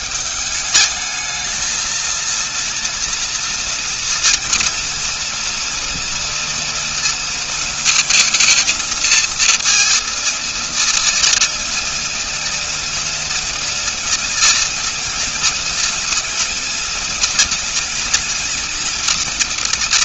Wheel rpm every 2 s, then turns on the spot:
200, 230, 230, 230, 220, 230, 230, 230, 230, 230.
none